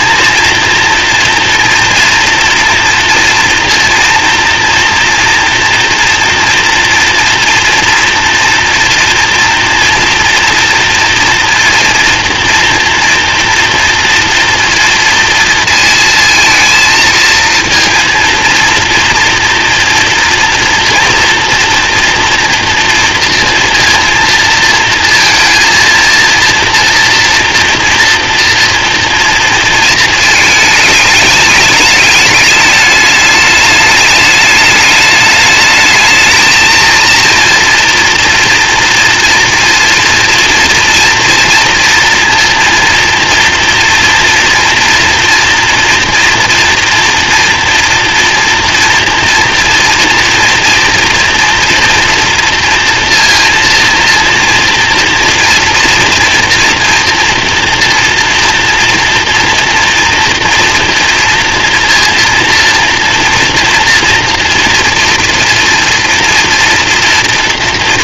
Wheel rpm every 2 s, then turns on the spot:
230, 230, 230, 240, 230, 230, 240, 230, 230, 230, 240, 230, 230, 230, 230, 220, 210, 210, 230, 230, 230, 230, 230, 230, 230, 230, 230, 230, 230, 230, 230, 230, 230, 230.
none